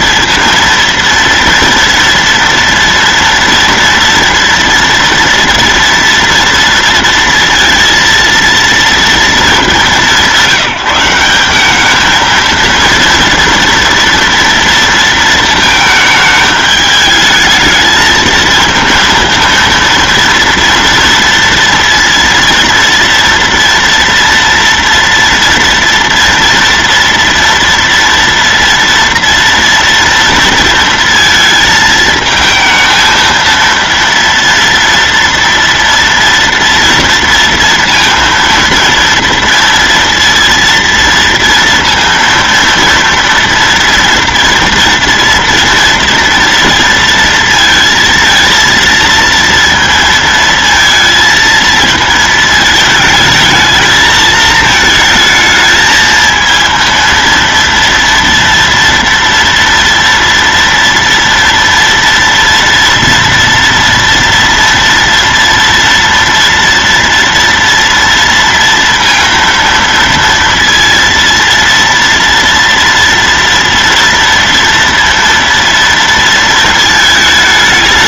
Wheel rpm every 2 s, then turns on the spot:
230, 230, 230, 230, 230, 190, 230, 230, 210, 220, 230, 230, 230, 230, 230, 230, 220, 230, 230, 230, 230, 230, 230, 230, 230, 230, 220, 220, 230, 230, 230, 230, 230, 230, 230, 230, 230, 230, 220.
none